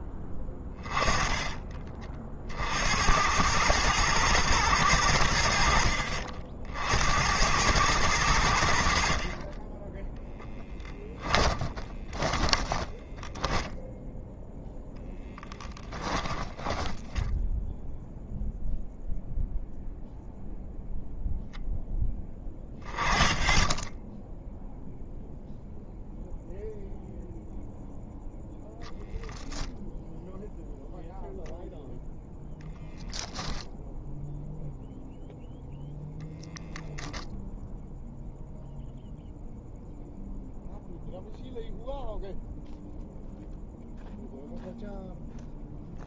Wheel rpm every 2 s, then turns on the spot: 20, 70, 100, 70, 70, 20, 10, 10, 10, 0, 0, 10, 0, 0, 0, 0, 0, 0, 0, 0, 0, 0, 0.
10-14 16-18